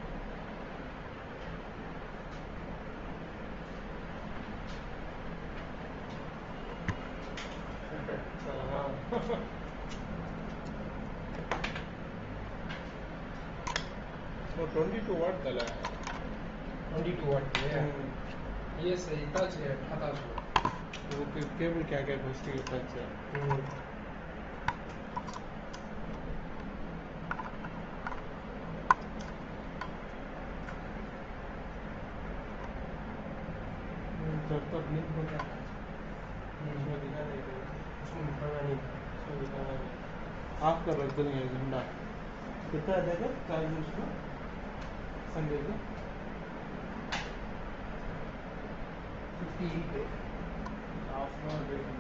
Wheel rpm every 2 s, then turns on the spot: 0, 0, 0, 0, 0, 0, 0, 0, 0, 0, 0, 0, 0, 0, 0, 0, 0, 0, 0, 0, 0, 0, 0, 0, 0, 0.
none